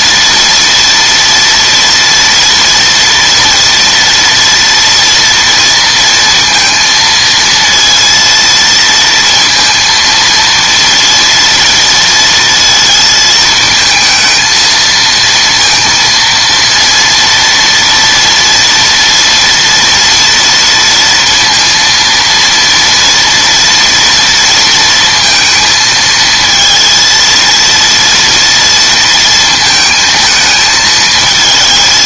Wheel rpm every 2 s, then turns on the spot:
230, 240, 230, 230, 230, 230, 230, 230, 230, 230, 230, 230, 230, 230, 230, 220.
none